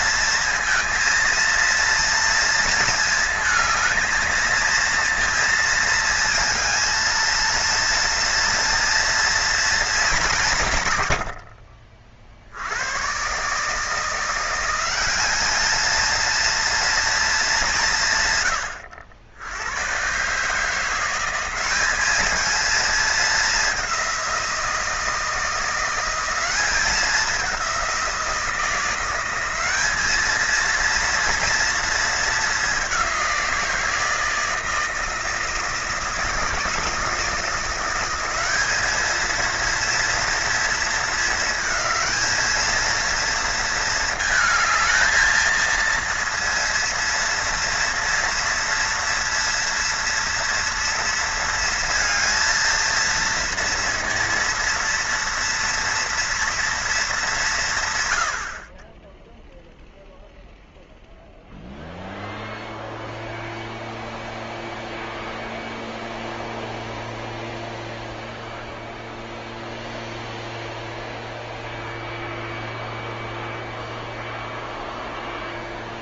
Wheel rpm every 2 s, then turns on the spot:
230, 230, 230, 220, 230, 130, 90, 190, 230, 80, 160, 220, 170, 190, 170, 230, 200, 160, 160, 210, 220, 220, 220, 230, 230, 230, 230, 230, 230, 40, 0, 0, 0, 0, 0, 0, 0, 0.
none